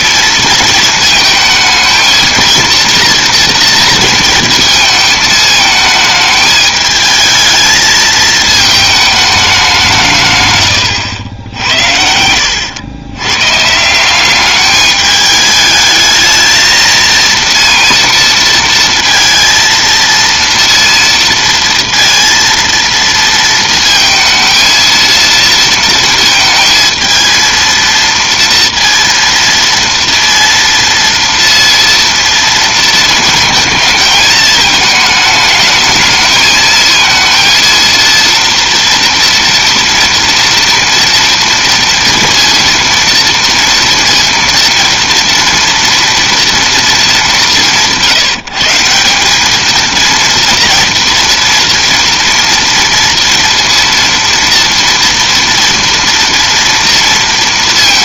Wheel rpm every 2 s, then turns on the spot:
220, 230, 220, 210, 220, 120, 90, 200, 220, 230, 230, 230, 230, 230, 230, 230, 230, 220, 220, 230, 230, 230, 230, 230, 160, 230, 230, 230, 230.
none